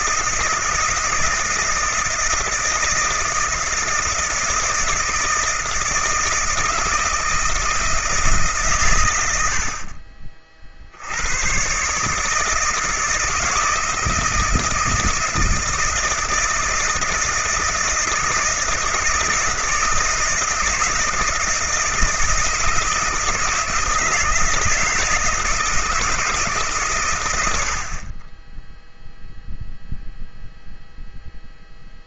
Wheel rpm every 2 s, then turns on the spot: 160, 160, 160, 160, 150, 40, 150, 160, 160, 160, 160, 160, 160, 150, 10, 0.
none